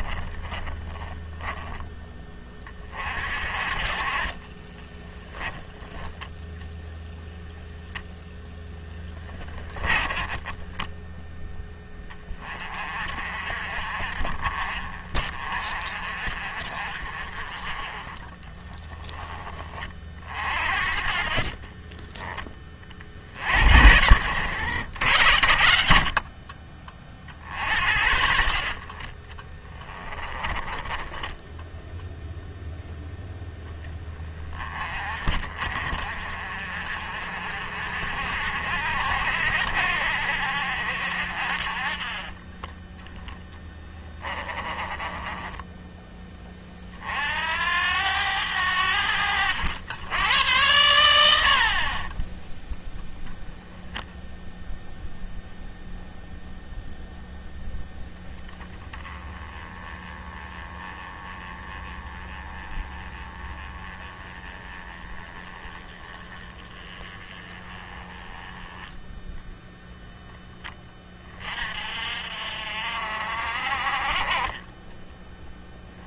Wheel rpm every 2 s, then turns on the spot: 10, 30, 20, 0, 10, 10, 40, 40, 50, 20, 50, 50, 90, 30, 40, 20, 0, 30, 50, 60, 60, 10, 20, 40, 90, 90, 10, 0, 0, 20, 20, 20, 20, 20, 10, 20, 50, 10.
0-2 4-6 8-10 30-32 44-46